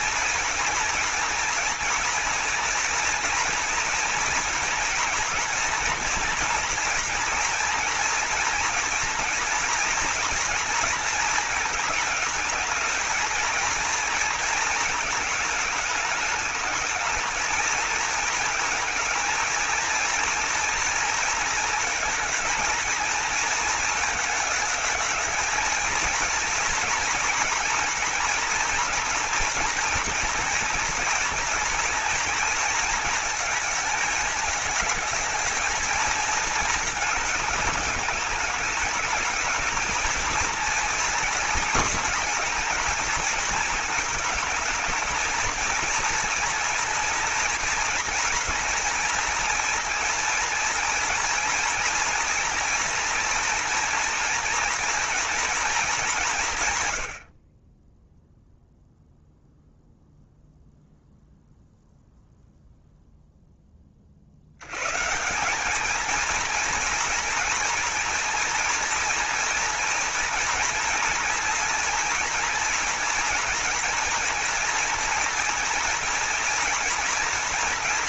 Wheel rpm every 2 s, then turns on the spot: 240, 230, 240, 240, 240, 230, 220, 230, 220, 220, 230, 230, 220, 230, 230, 240, 230, 220, 220, 210, 230, 220, 220, 230, 230, 230, 240, 240, 120, 0, 0, 0, 120, 230, 240, 230, 230, 240, 240.
none